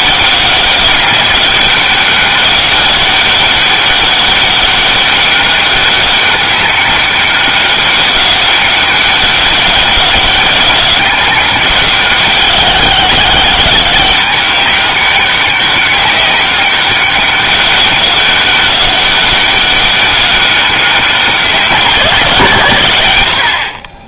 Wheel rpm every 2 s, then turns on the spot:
200, 200, 200, 200, 200, 190, 190, 200, 190, 200, 200, 130.
none